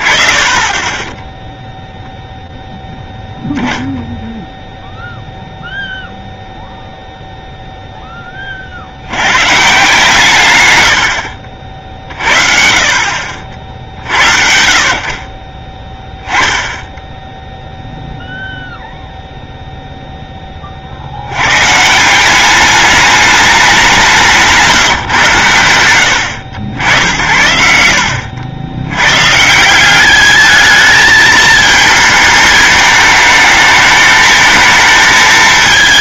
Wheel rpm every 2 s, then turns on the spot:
30, 0, 0, 0, 120, 50, 40, 50, 0, 0, 90, 210, 140, 70, 130, 220, 220, 220.
none